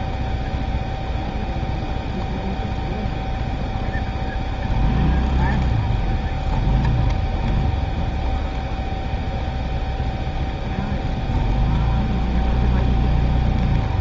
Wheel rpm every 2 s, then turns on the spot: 0, 0, 0, 0, 0, 0, 0.
none